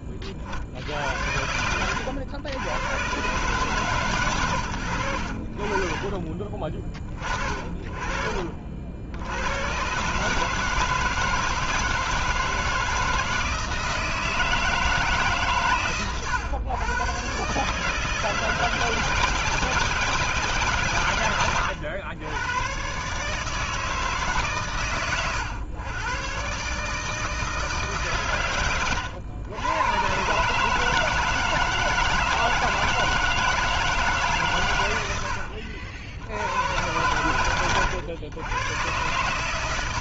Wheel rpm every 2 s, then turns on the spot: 50, 100, 90, 30, 50, 160, 160, 160, 120, 160, 140, 110, 140, 130, 120, 140, 160, 120, 100, 120.
none